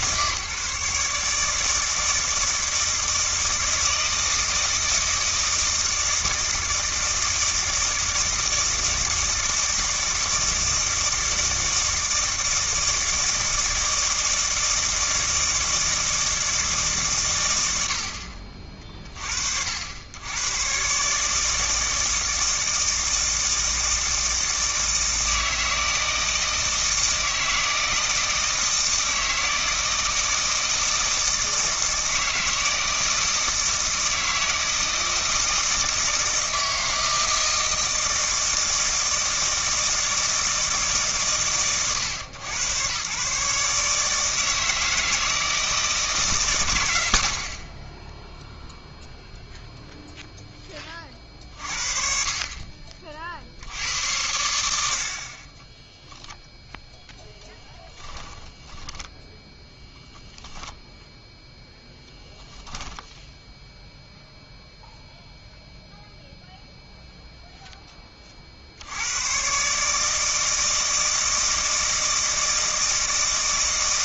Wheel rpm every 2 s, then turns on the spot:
150, 160, 160, 160, 160, 160, 160, 160, 160, 50, 110, 160, 160, 160, 160, 160, 160, 160, 160, 160, 160, 110, 160, 120, 0, 10, 40, 80, 0, 20, 0, 10, 0, 0, 50, 160, 160.
58-60 62-64